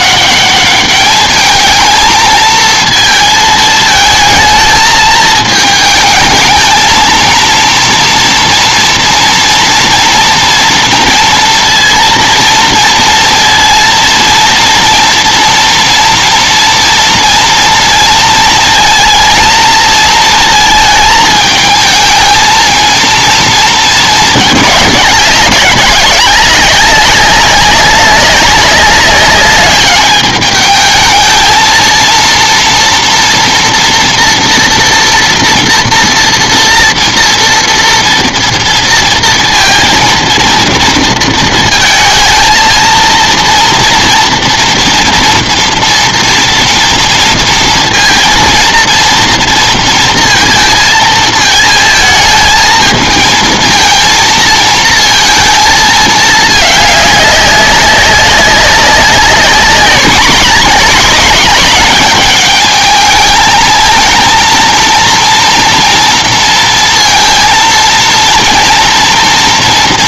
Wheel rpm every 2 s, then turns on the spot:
210, 230, 220, 220, 230, 230, 230, 230, 230, 230, 230, 230, 200, 190, 190, 210, 230, 230, 230, 230, 230, 220, 230, 230, 230, 230, 220, 230, 210, 200, 220, 220, 230, 230, 230.
none